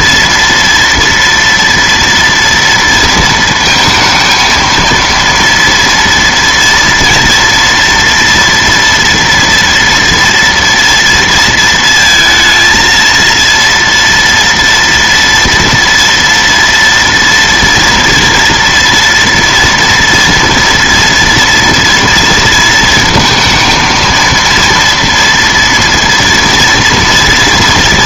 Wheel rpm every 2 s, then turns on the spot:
230, 230, 230, 230, 230, 230, 230, 240, 230, 230, 230, 230, 230, 230.
none